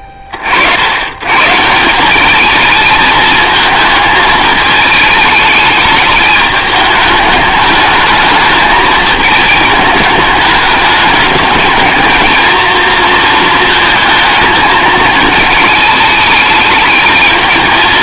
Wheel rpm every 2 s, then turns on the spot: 50, 220, 220, 210, 220, 210, 230, 220, 210.
none